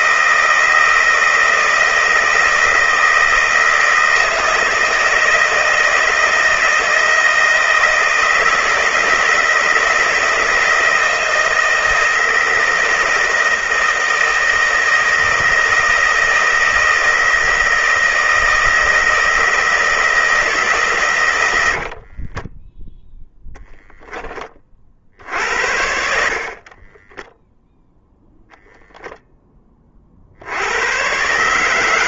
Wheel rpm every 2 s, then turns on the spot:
160, 160, 160, 160, 160, 160, 160, 160, 160, 160, 140, 10, 40, 30, 0, 110.
22-24 26-28